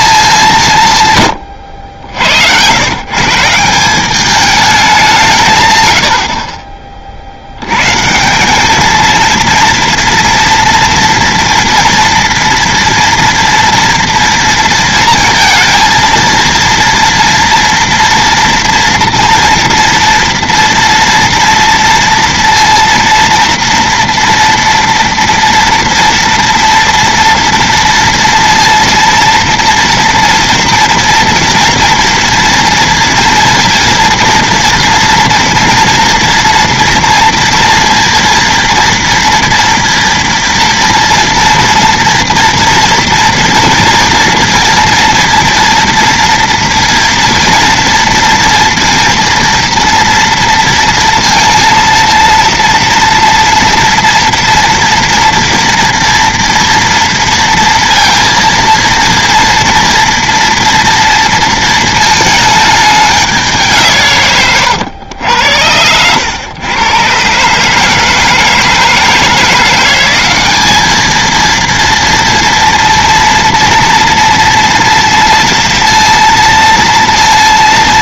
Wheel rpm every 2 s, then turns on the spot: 160, 130, 210, 40, 200, 230, 230, 230, 230, 230, 230, 230, 230, 230, 230, 230, 230, 230, 230, 230, 230, 230, 230, 230, 230, 230, 230, 230, 230, 230, 230, 220, 120, 120, 160, 210, 230, 230, 230.
none